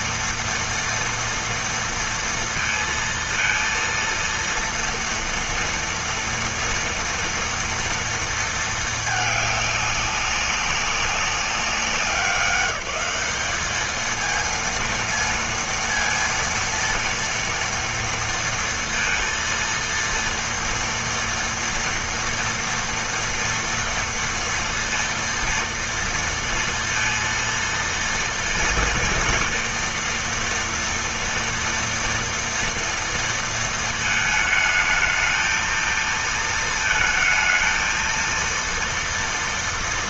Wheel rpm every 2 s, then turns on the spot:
230, 230, 230, 230, 230, 200, 190, 220, 230, 230, 230, 230, 230, 230, 230, 230, 230, 220, 230, 230.
none